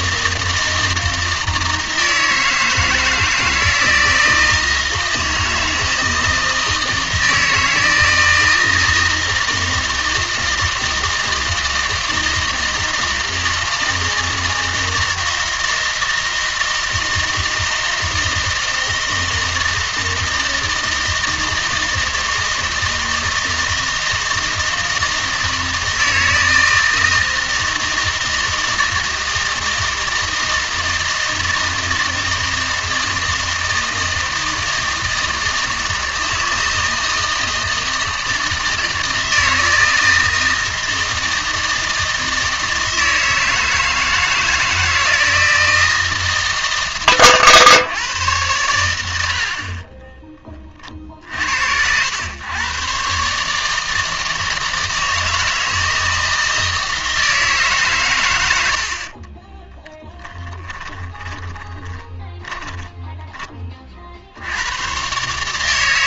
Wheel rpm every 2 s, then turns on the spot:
160, 160, 160, 160, 160, 160, 160, 160, 160, 160, 160, 160, 160, 160, 160, 160, 160, 160, 160, 160, 160, 160, 160, 140, 110, 40, 120, 160, 160, 70, 20, 20, 110.
60-64